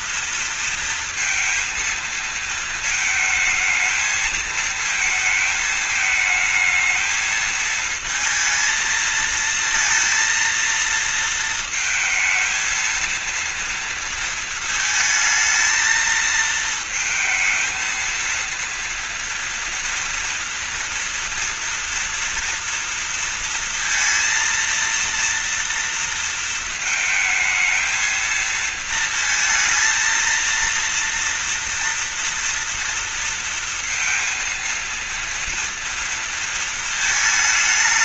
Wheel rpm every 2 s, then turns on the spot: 230, 230, 220, 220, 230, 230, 230, 220, 220, 230, 230, 230, 230, 220, 220, 230, 230, 230, 230.
none